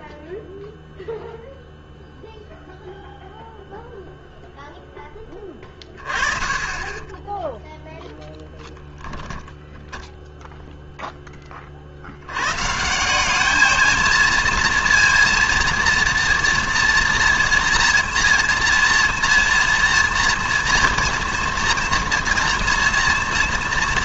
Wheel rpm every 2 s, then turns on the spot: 0, 0, 0, 20, 10, 0, 150, 230, 230, 230, 230, 230.
6-10